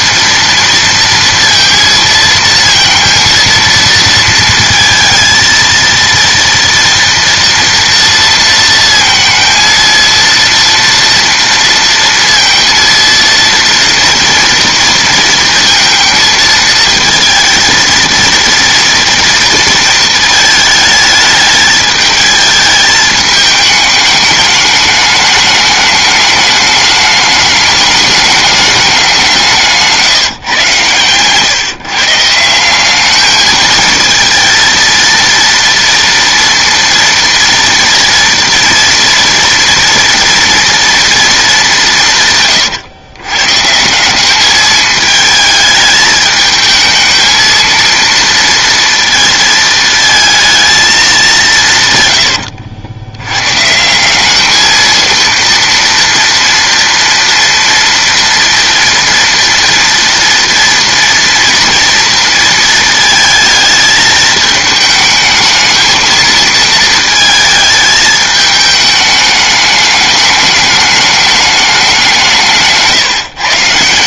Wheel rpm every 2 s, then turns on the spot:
230, 230, 230, 230, 230, 230, 230, 230, 220, 230, 220, 220, 210, 210, 200, 120, 180, 230, 230, 240, 240, 120, 210, 220, 230, 220, 90, 220, 230, 240, 230, 230, 220, 230, 210, 210, 160.
52-54